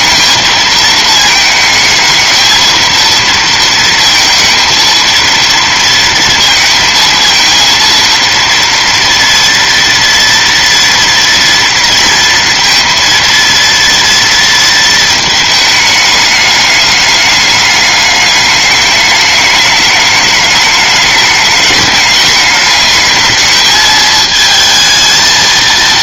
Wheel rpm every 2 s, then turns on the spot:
220, 230, 230, 220, 230, 230, 230, 220, 210, 210, 210, 210, 220.
none